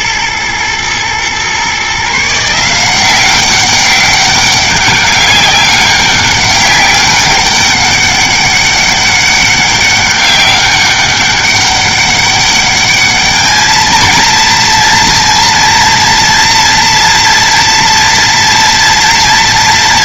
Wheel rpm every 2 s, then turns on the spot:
110, 180, 190, 200, 200, 200, 210, 230, 230, 230.
none